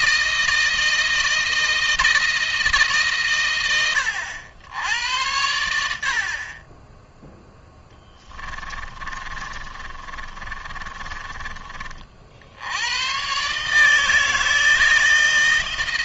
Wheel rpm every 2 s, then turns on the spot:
160, 140, 80, 10, 30, 30, 100, 160.
8-10